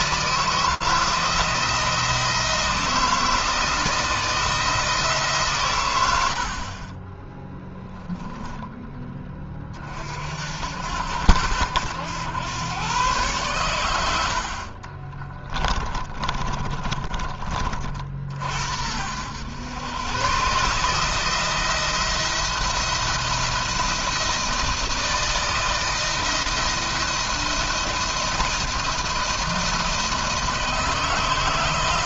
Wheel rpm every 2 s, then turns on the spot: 160, 160, 160, 20, 20, 80, 110, 30, 30, 80, 160, 170, 160, 160, 170, 160.
14-16